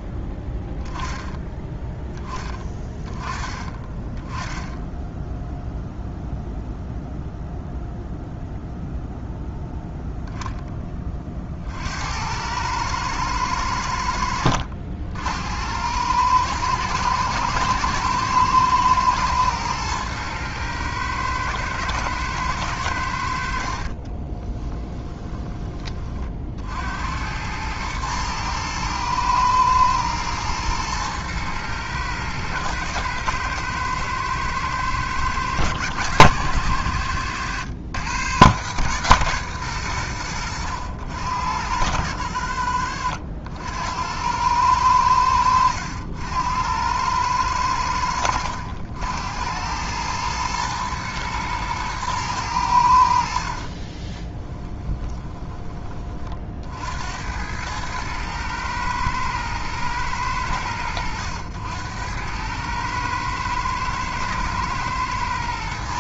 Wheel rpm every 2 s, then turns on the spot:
0, 20, 10, 0, 0, 0, 100, 70, 110, 110, 110, 100, 20, 60, 110, 110, 110, 110, 110, 130, 80, 60, 100, 80, 80, 110, 100, 20, 50, 110, 90, 110, 110.
24-26 54-56